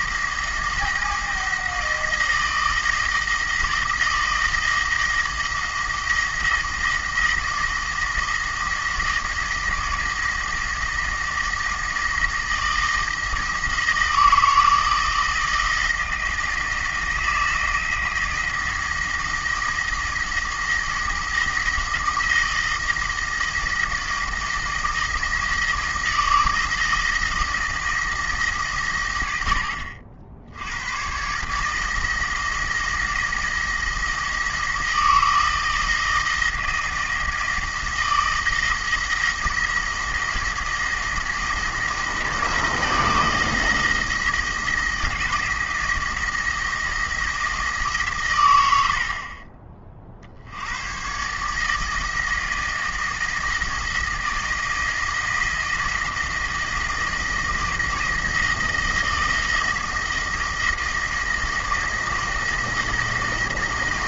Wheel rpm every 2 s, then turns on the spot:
160, 160, 160, 170, 170, 160, 160, 160, 160, 160, 170, 170, 160, 160, 140, 90, 160, 170, 160, 160, 160, 170, 160, 170, 90, 100, 160, 160, 170, 170, 160, 160.
none